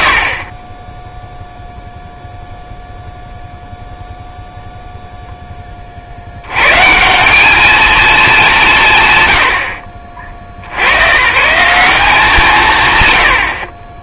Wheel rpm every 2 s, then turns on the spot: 30, 0, 0, 120, 220, 60, 90.
none